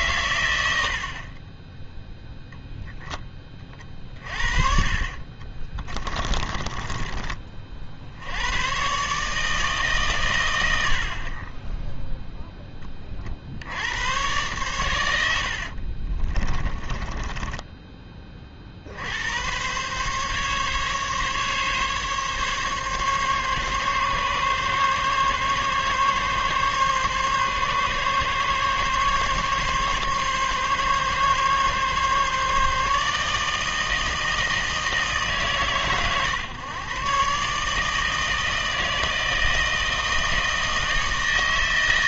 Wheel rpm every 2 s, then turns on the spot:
80, 0, 40, 30, 120, 80, 20, 110, 30, 50, 140, 140, 140, 140, 140, 140, 150, 160, 120, 160, 160.
6-8 16-18